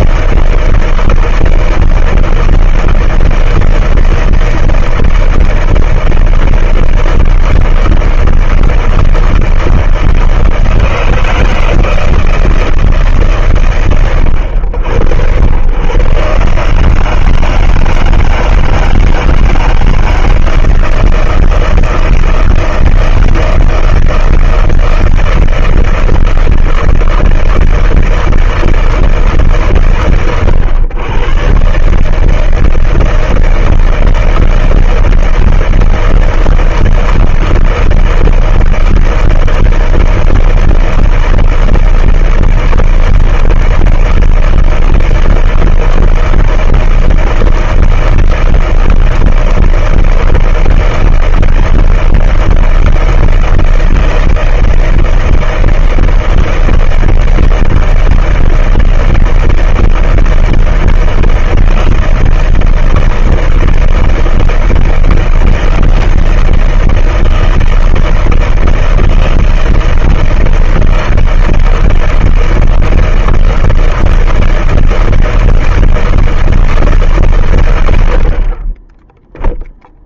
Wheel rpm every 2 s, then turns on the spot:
160, 160, 160, 160, 160, 160, 160, 80, 140, 160, 160, 160, 160, 160, 160, 120, 150, 160, 160, 160, 160, 160, 160, 160, 160, 160, 160, 160, 160, 160, 160, 160, 160, 160, 160, 160, 160, 160, 160, 130.
none